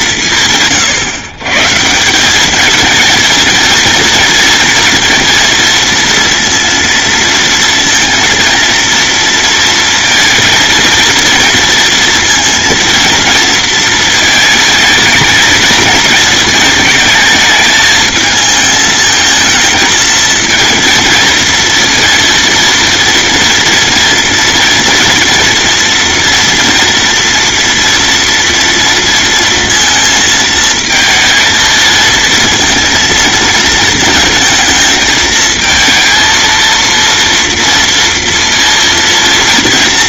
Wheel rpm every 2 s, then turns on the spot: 150, 210, 230, 230, 230, 230, 230, 230, 220, 220, 230, 230, 230, 230, 230, 220, 220, 220, 230, 230.
none